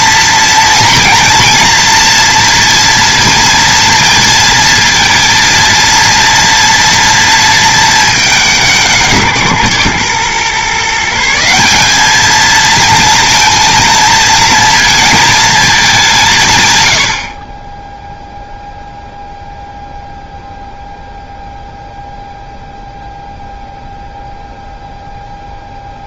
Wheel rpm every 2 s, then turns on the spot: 230, 230, 230, 230, 170, 150, 220, 230, 110, 0, 0, 0, 0.
none